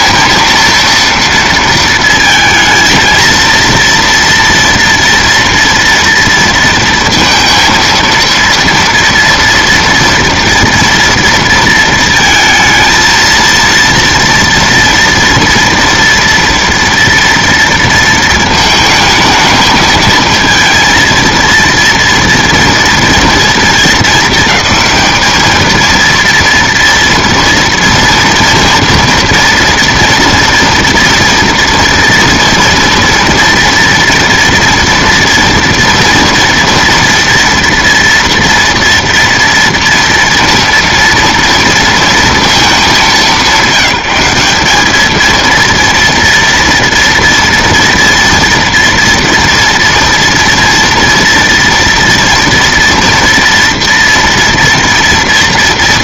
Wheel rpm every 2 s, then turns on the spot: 230, 230, 230, 230, 230, 230, 220, 230, 230, 220, 220, 230, 220, 230, 230, 230, 230, 230, 230, 230, 230, 220, 200, 230, 230, 230, 230, 230.
none